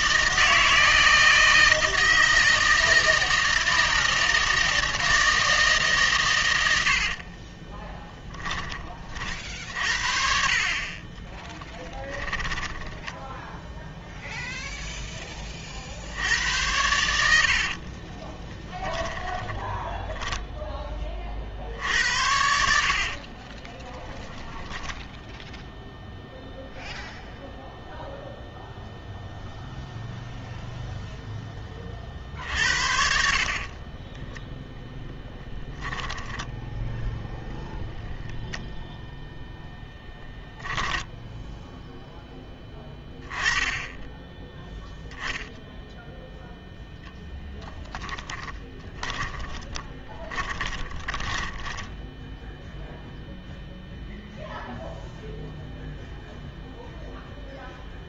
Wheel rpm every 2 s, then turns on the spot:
160, 160, 160, 90, 20, 40, 10, 0, 100, 10, 10, 70, 0, 0, 0, 0, 60, 10, 10, 0, 10, 10, 0, 0, 20, 10, 0, 0, 0.
12-14 18-20 22-24 32-34 36-38 48-52